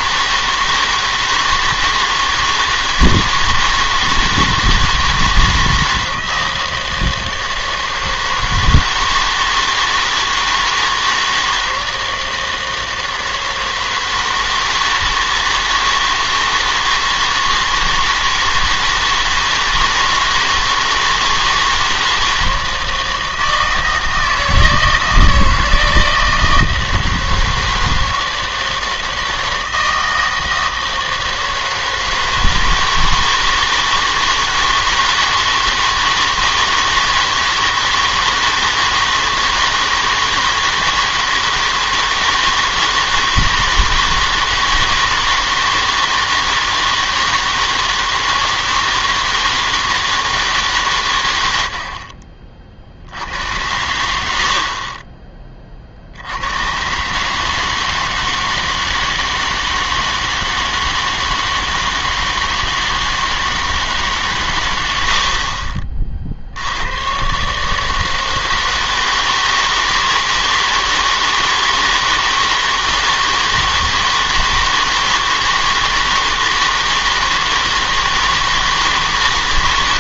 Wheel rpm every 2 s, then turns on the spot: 160, 160, 160, 160, 160, 160, 160, 160, 160, 160, 160, 160, 160, 160, 160, 160, 160, 160, 160, 160, 160, 160, 160, 160, 160, 150, 40, 50, 110, 160, 160, 160, 100, 80, 160, 160, 160, 160, 160, 160.
none